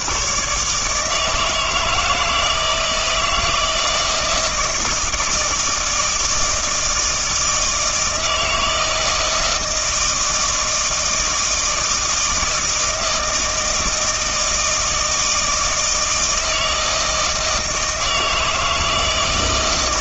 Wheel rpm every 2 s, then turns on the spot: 140, 160, 160, 160, 160, 160, 160, 160, 160, 160.
none